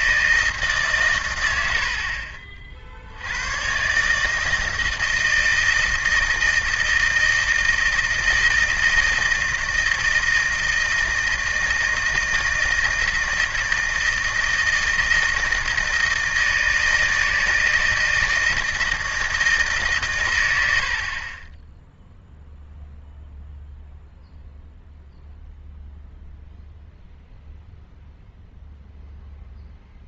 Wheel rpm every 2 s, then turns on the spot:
160, 50, 160, 160, 160, 160, 160, 160, 160, 160, 90, 0, 0, 0, 0.
none